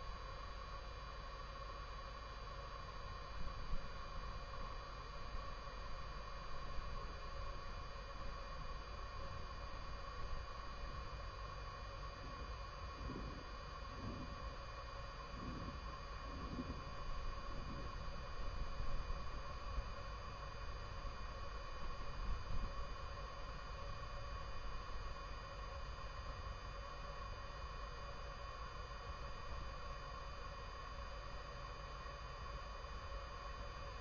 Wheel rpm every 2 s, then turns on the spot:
0, 0, 0, 0, 0, 0, 0, 0, 0, 0, 0, 0, 0, 0, 0, 0, 0.
none